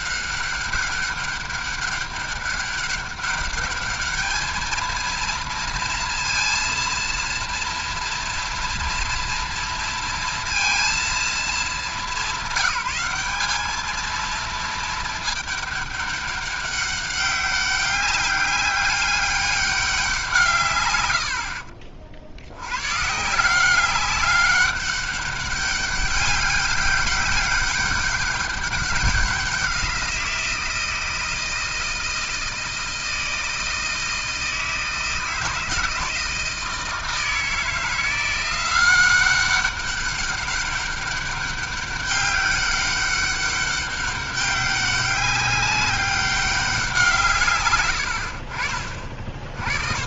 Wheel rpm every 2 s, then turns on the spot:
190, 200, 220, 230, 230, 230, 200, 230, 200, 200, 150, 90, 200, 200, 190, 170, 160, 160, 160, 180, 200, 200, 200, 190, 40.
none